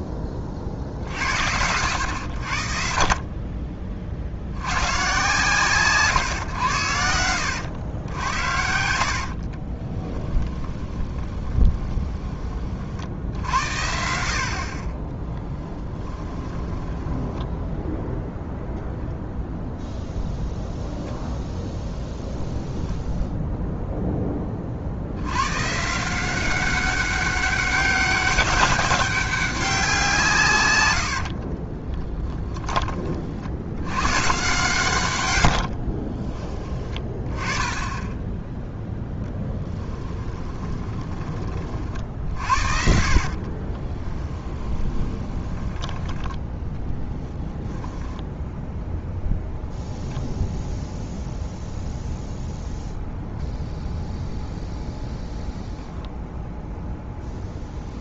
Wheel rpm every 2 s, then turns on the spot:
50, 60, 110, 100, 60, 20, 50, 40, 10, 0, 0, 0, 60, 190, 190, 100, 20, 120, 20, 0, 20, 40, 20, 10, 0, 0, 0, 0, 0.
8-12 16-18 30-32 40-46